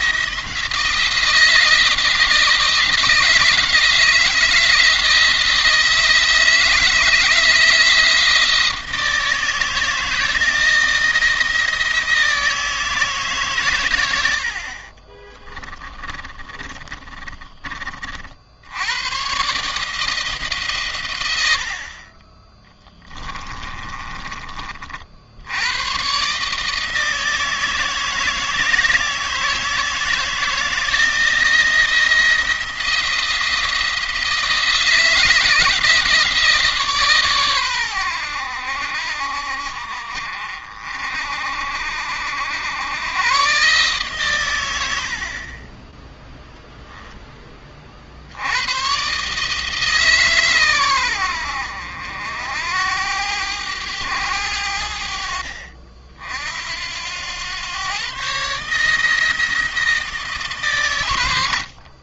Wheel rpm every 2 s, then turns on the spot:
170, 170, 160, 160, 160, 170, 160, 30, 30, 90, 120, 10, 40, 160, 160, 170, 170, 160, 150, 70, 50, 100, 90, 0, 120, 110, 80, 70, 80, 150, 130.
14-18 22-24